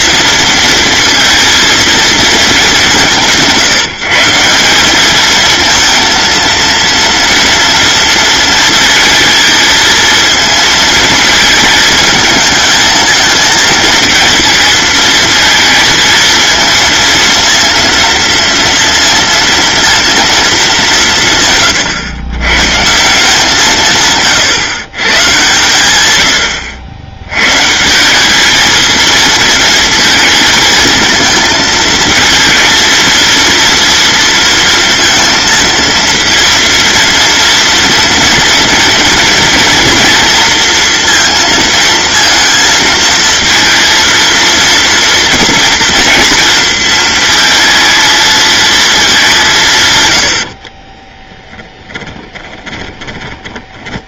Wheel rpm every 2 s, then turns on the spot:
230, 210, 190, 230, 230, 230, 220, 230, 220, 230, 200, 130, 140, 80, 220, 230, 230, 230, 230, 230, 230, 230, 230, 220, 220, 40, 10.
50-54